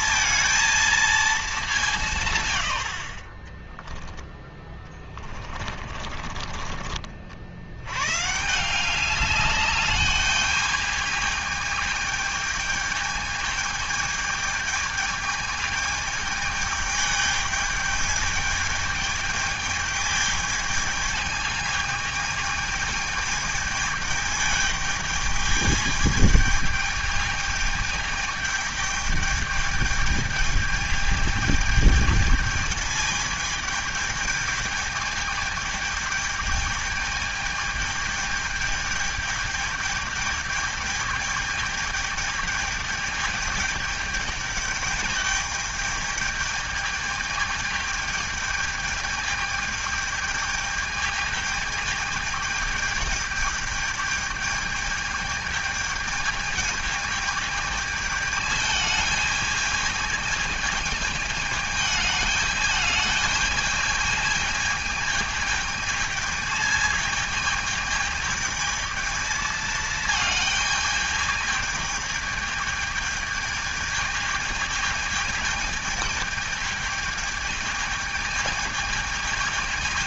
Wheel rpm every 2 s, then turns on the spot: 230, 90, 20, 40, 190, 210, 220, 220, 210, 210, 220, 210, 210, 220, 210, 210, 220, 210, 210, 210, 210, 210, 210, 210, 210, 210, 210, 210, 220, 220, 210, 210, 220, 220, 220, 220, 220, 220, 220, 220.
4-6